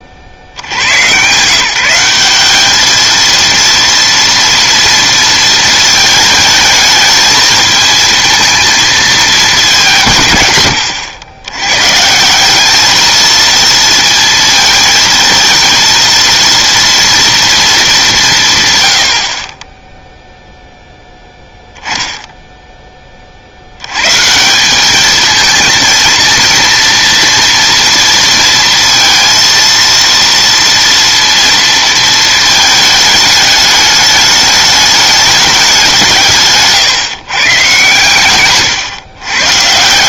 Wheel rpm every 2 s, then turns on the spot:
90, 210, 230, 210, 220, 120, 210, 220, 230, 130, 0, 10, 190, 230, 230, 230, 220, 210, 140, 130.
none